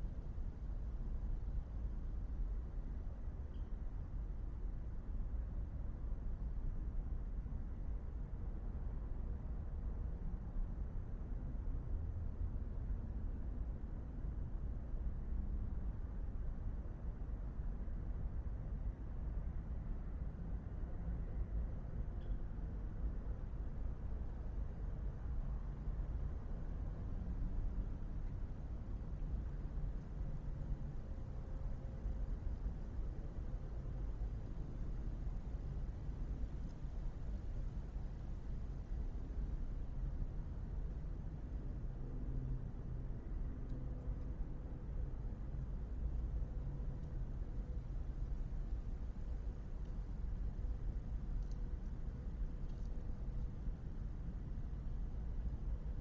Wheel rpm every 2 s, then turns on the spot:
0, 0, 0, 0, 0, 0, 0, 0, 0, 0, 0, 0, 0, 0, 0, 0, 0, 0, 0, 0, 0, 0, 0, 0, 0, 0, 0, 0.
none